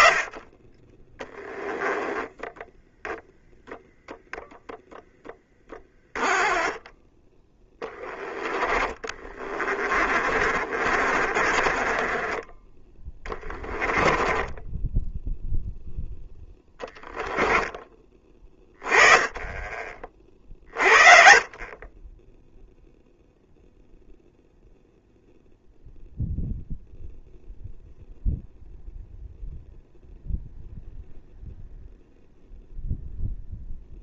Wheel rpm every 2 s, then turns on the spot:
10, 0, 10, 10, 20, 50, 30, 10, 10, 20, 40, 0, 0, 0, 0, 0, 0.
6-12 14-18